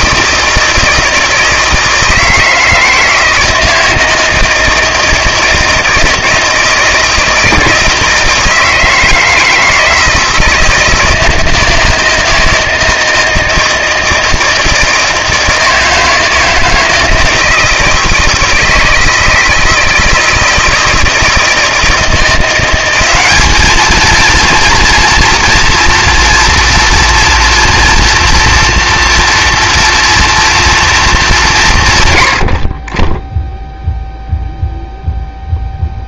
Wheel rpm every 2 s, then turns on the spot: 160, 160, 160, 160, 160, 160, 160, 160, 160, 160, 160, 180, 230, 230, 230, 240, 60, 0.
none